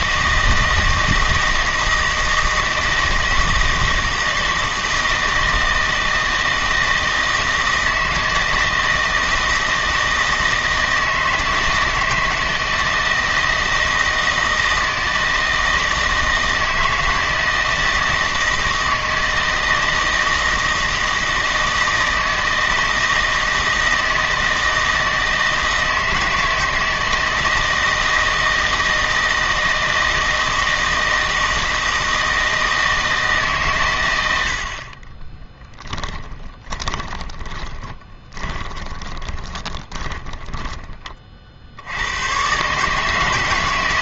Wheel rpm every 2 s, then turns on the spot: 160, 160, 160, 160, 160, 160, 160, 160, 160, 160, 160, 160, 160, 160, 160, 160, 160, 50, 30, 20, 20, 140.
36-40